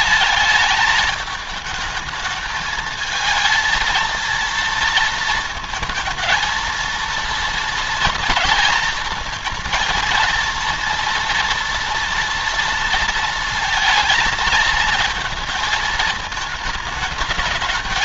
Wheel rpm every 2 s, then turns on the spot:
220, 220, 230, 230, 230, 230, 230, 230, 220.
none